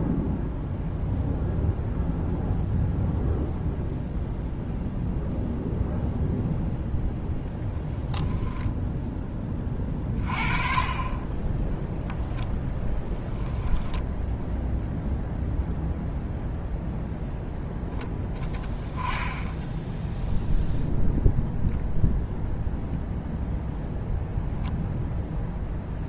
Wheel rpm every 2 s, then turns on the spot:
0, 0, 0, 0, 0, 30, 10, 0, 0, 10, 0, 0, 0.
12-14